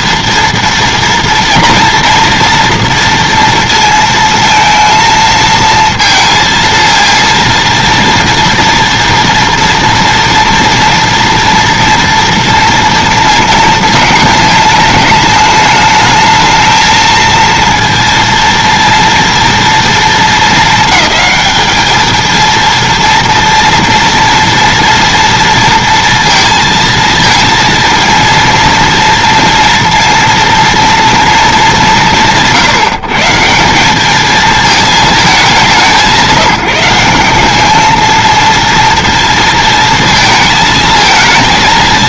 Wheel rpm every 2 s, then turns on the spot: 230, 240, 220, 220, 230, 230, 230, 210, 220, 230, 220, 230, 230, 230, 230, 230, 130, 220, 170, 230, 220.
none